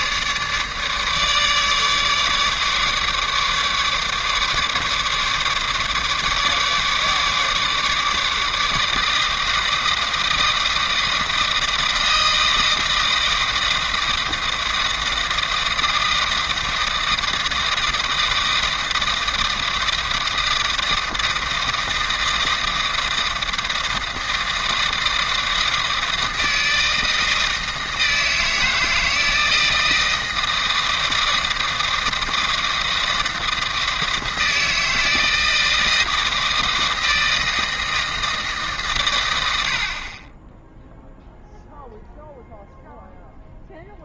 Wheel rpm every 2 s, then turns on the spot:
150, 150, 150, 150, 150, 160, 160, 160, 160, 160, 160, 160, 160, 160, 160, 160, 160, 160, 160, 160, 80, 0.
none